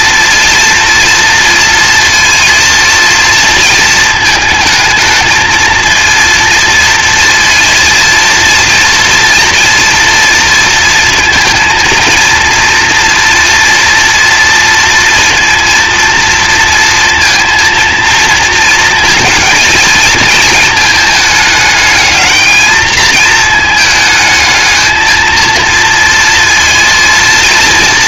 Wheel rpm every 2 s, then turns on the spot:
230, 230, 220, 230, 230, 230, 230, 230, 230, 230, 230, 220, 220, 230.
none